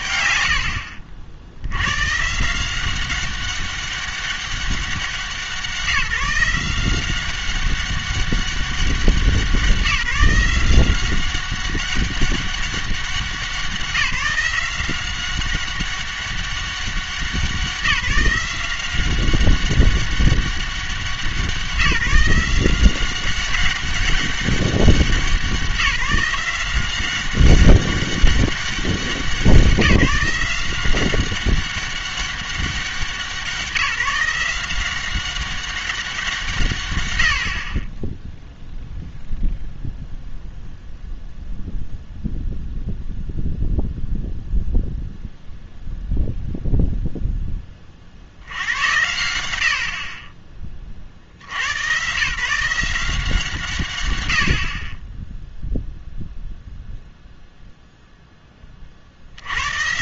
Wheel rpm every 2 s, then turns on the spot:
90, 170, 190, 170, 190, 180, 200, 180, 190, 180, 200, 180, 200, 180, 190, 180, 190, 180, 130, 0, 0, 0, 0, 0, 90, 30, 160, 50, 0, 30.
none